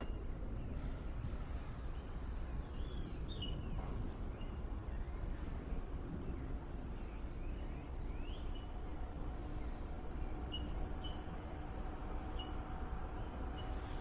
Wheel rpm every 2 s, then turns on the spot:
0, 0, 0, 0, 0, 0, 0.
none